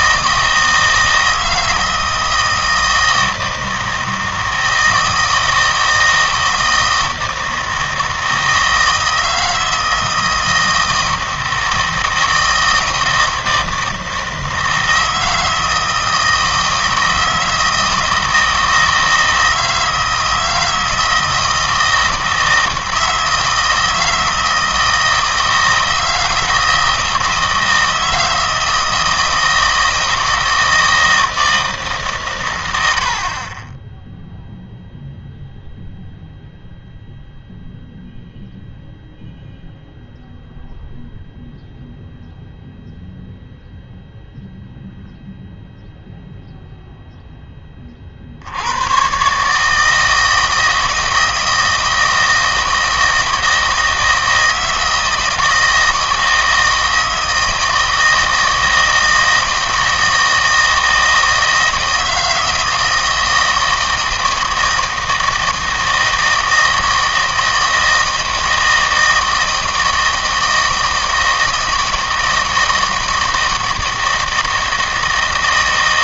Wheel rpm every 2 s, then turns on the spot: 160, 160, 160, 160, 160, 160, 160, 160, 160, 160, 160, 160, 160, 160, 160, 160, 100, 0, 0, 0, 0, 0, 0, 0, 90, 160, 160, 160, 160, 160, 160, 160, 160, 160, 160, 160, 160, 160.
none